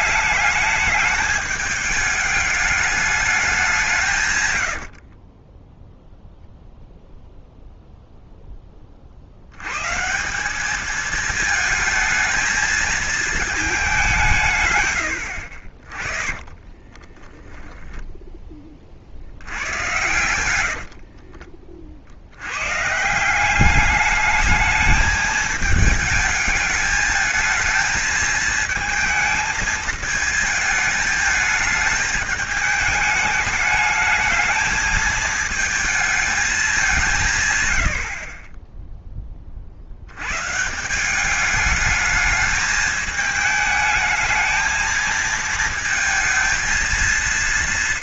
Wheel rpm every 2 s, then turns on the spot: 210, 220, 80, 0, 30, 210, 220, 120, 20, 40, 70, 120, 220, 220, 220, 220, 210, 220, 190, 10, 160, 220, 220, 230.
4-6 16-18 20-22